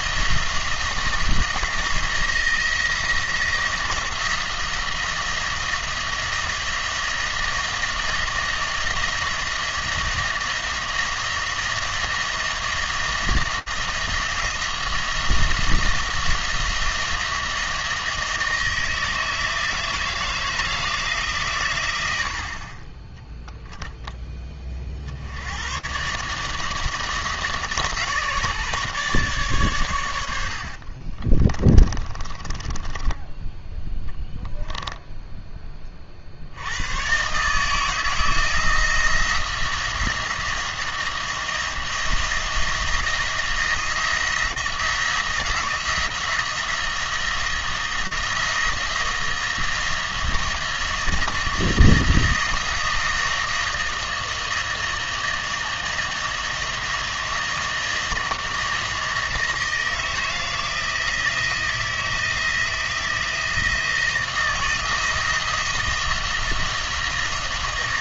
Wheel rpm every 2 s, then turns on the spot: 170, 170, 170, 170, 170, 170, 170, 170, 170, 160, 160, 20, 50, 160, 150, 50, 20, 0, 110, 170, 170, 170, 170, 170, 160, 170, 160, 160, 160, 170, 160, 160, 160, 170.
30-34